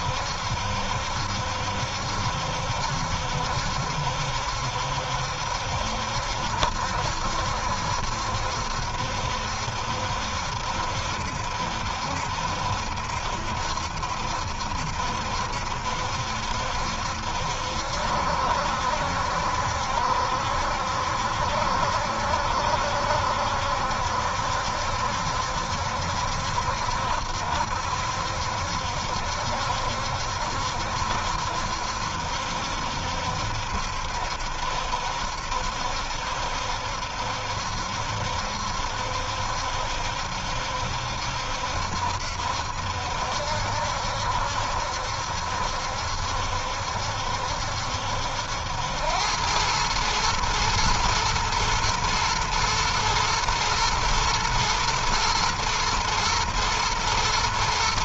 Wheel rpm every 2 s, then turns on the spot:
70, 70, 70, 70, 70, 70, 70, 70, 70, 70, 70, 70, 70, 70, 70, 70, 70, 70, 70, 70, 70, 70, 70, 70, 80, 110, 120, 120, 120.
none